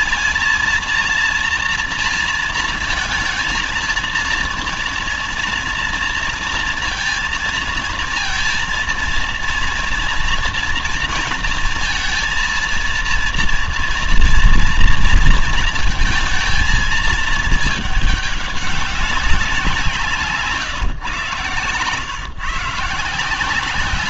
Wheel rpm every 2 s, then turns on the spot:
230, 230, 230, 230, 230, 230, 230, 230, 230, 210, 140, 130.
none